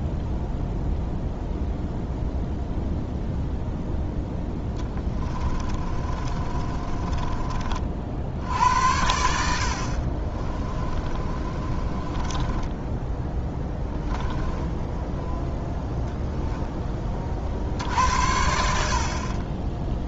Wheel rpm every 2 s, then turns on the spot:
0, 0, 10, 30, 80, 30, 10, 10, 20, 60.
4-8 10-16